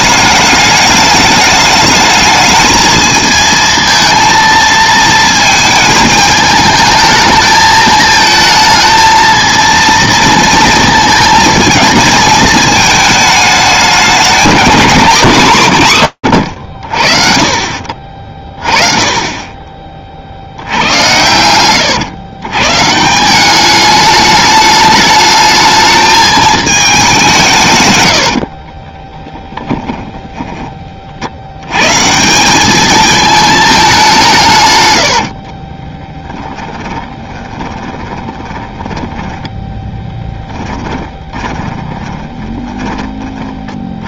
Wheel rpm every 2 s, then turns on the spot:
210, 220, 220, 220, 220, 230, 220, 210, 70, 30, 70, 120, 210, 210, 40, 30, 210, 100, 20, 10, 10, 20.
28-30 34-42